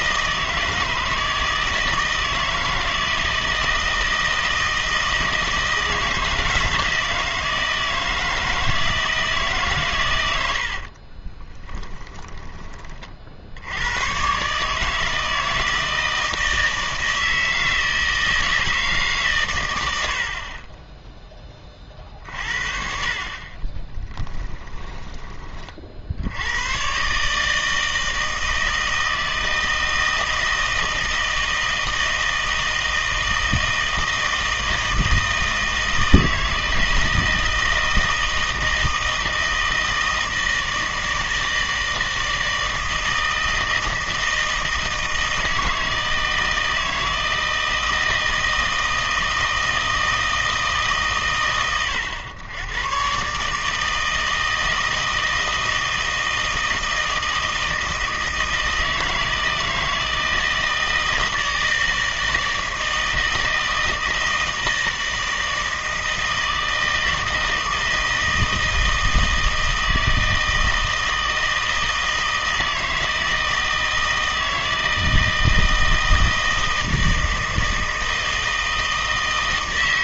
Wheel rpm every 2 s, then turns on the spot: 160, 160, 160, 160, 160, 60, 20, 150, 160, 150, 20, 60, 10, 120, 160, 160, 160, 160, 160, 160, 160, 160, 160, 160, 160, 110, 110, 160, 160, 160, 160, 160, 160, 160, 160, 160, 160, 160, 160, 160.
10-12 20-22 24-26